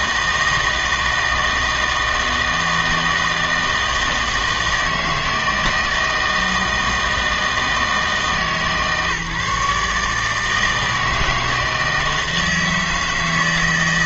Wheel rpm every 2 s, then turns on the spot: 160, 160, 160, 160, 150, 160, 160.
none